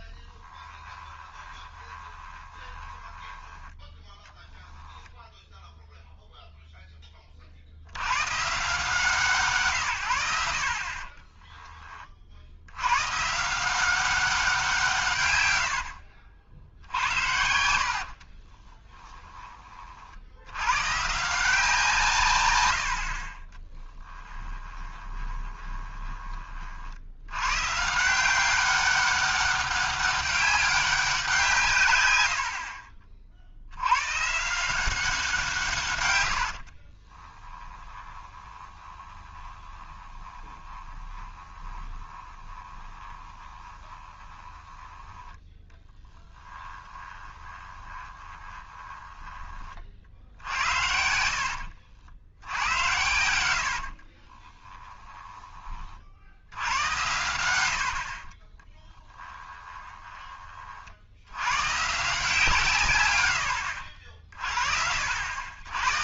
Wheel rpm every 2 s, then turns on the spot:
10, 20, 0, 0, 140, 70, 70, 180, 70, 30, 100, 100, 10, 40, 190, 200, 60, 160, 70, 20, 20, 20, 10, 20, 20, 60, 80, 20, 90, 30, 40, 150, 50.
0-4 16-20 24-26 32-34 36-50 52-56 58-60